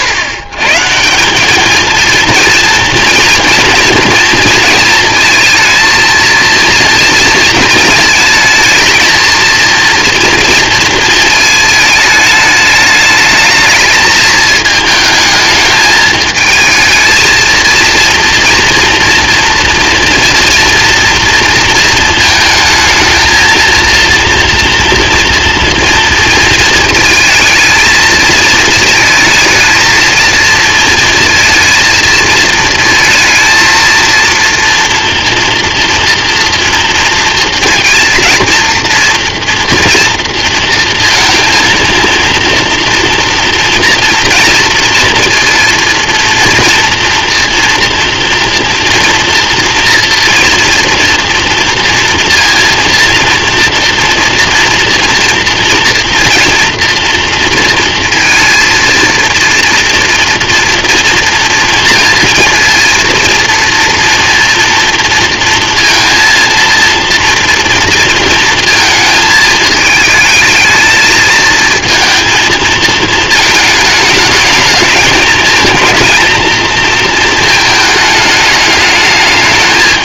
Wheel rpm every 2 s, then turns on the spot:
130, 240, 230, 230, 220, 230, 220, 220, 220, 230, 240, 230, 230, 230, 220, 230, 230, 240, 230, 230, 230, 230, 230, 230, 230, 230, 230, 240, 240, 230, 240, 230, 230, 230, 220, 220, 220, 220, 230, 210.
none